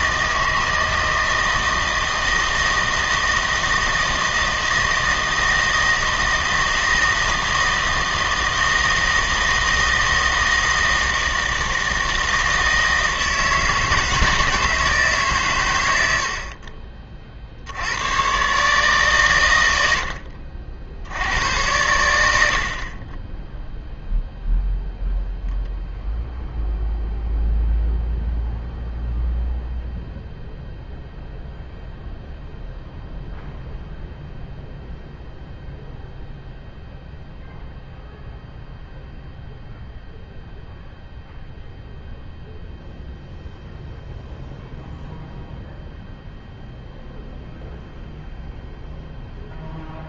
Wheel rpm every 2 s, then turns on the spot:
160, 160, 160, 160, 160, 160, 160, 160, 40, 140, 60, 60, 0, 0, 0, 0, 0, 0, 0, 0, 0, 0, 0, 0, 0.
none